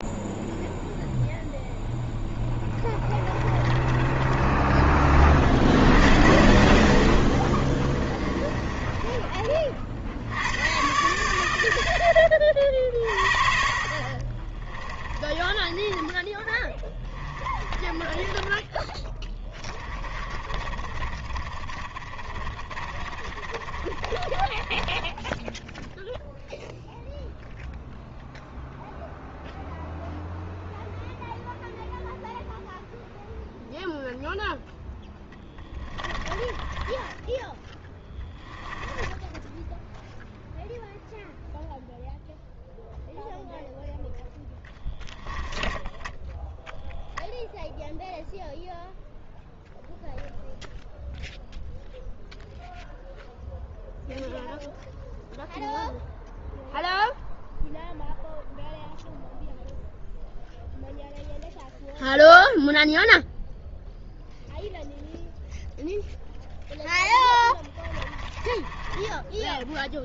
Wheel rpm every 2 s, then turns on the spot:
0, 20, 10, 40, 30, 90, 60, 30, 20, 20, 30, 30, 20, 0, 0, 0, 0, 0, 20, 10, 0, 0, 10, 0, 0, 0, 0, 0, 0, 0, 0, 0, 0, 0, 20.
2-4 8-10 14-26 36-40 44-46 68-70